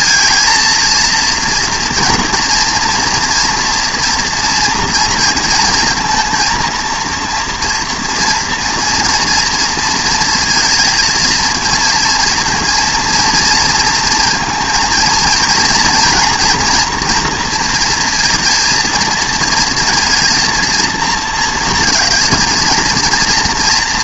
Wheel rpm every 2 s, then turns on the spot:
230, 230, 230, 230, 230, 230, 230, 230, 240, 230, 230, 220.
none